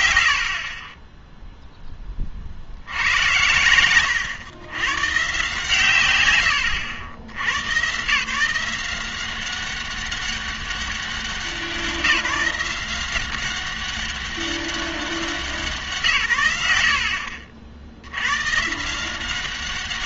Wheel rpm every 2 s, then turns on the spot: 70, 70, 110, 90, 170, 200, 170, 200, 80, 140.
none